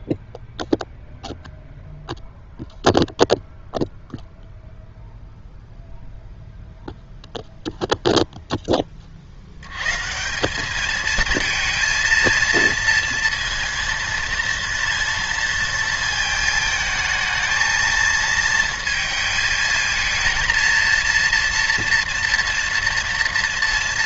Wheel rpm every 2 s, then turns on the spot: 0, 0, 0, 0, 10, 200, 230, 230, 220, 230, 230, 230.
none